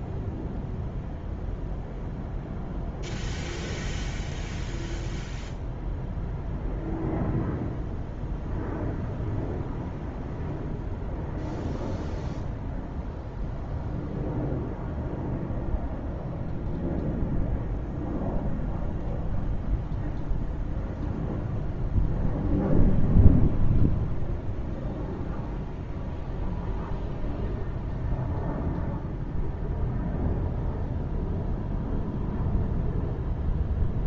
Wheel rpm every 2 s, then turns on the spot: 0, 0, 0, 0, 0, 0, 0, 0, 0, 0, 0, 0, 0, 0, 0, 0, 0.
none